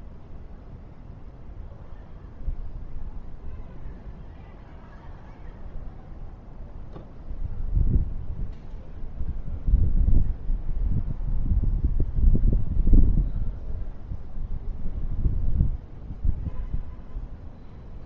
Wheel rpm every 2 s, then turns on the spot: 0, 0, 0, 0, 0, 0, 0, 0, 0.
none